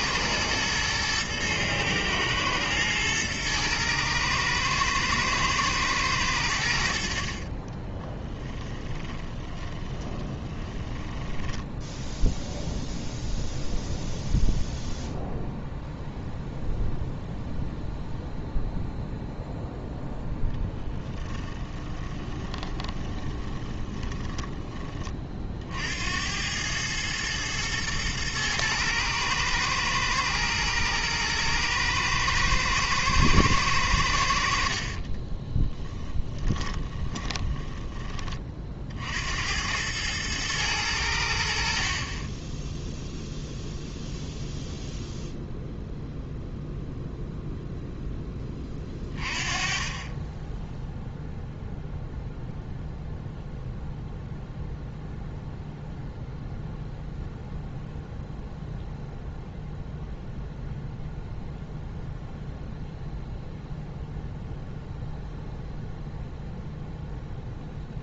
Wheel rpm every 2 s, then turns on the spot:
110, 110, 110, 80, 10, 10, 0, 0, 0, 0, 10, 20, 20, 100, 110, 110, 110, 60, 20, 50, 100, 0, 0, 0, 20, 10, 0, 0, 0, 0, 0, 0, 0, 0.
8-12 22-24 34-38